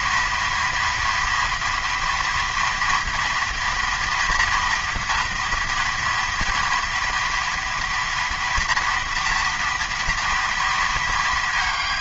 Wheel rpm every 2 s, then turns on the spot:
230, 230, 240, 230, 230, 210.
none